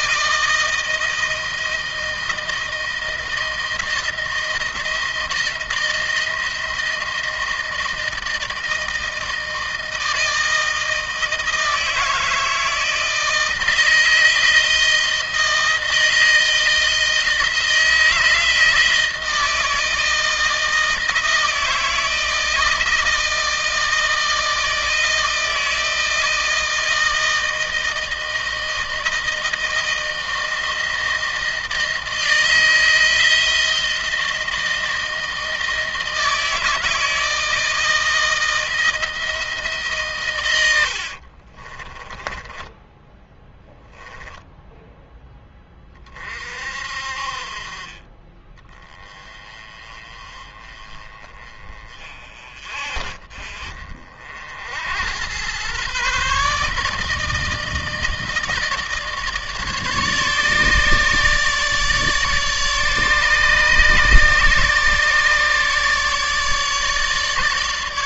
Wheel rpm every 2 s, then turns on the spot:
160, 160, 170, 160, 160, 160, 160, 170, 160, 160, 160, 160, 160, 160, 160, 160, 160, 160, 160, 160, 110, 10, 0, 40, 20, 30, 40, 70, 140, 160, 150, 150, 150, 150.
42-44